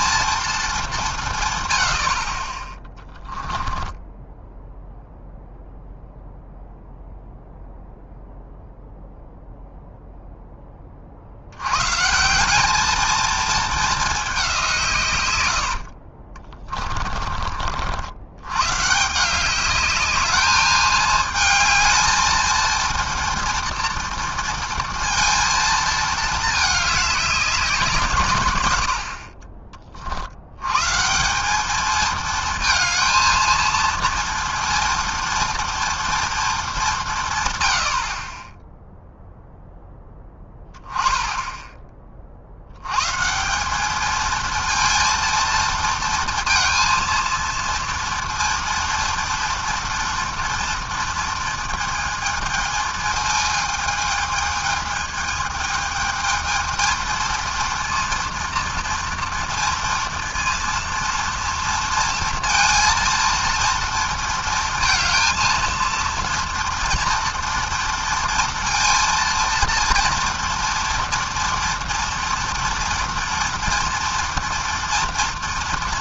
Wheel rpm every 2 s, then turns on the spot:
230, 40, 10, 0, 0, 10, 190, 180, 30, 110, 210, 220, 230, 210, 120, 110, 220, 230, 220, 20, 10, 70, 230, 230, 230, 230, 220, 220, 220, 230, 230, 230, 220, 230, 230, 230, 230, 230.
4-6 16-18